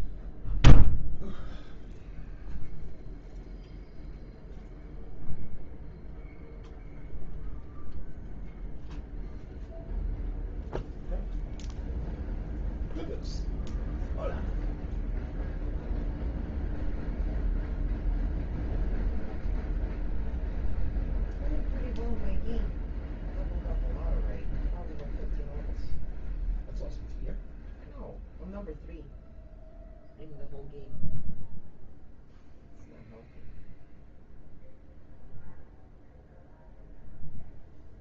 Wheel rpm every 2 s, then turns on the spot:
0, 0, 0, 0, 0, 0, 0, 0, 0, 0, 0, 0, 0, 0, 0, 0, 0, 0, 0.
none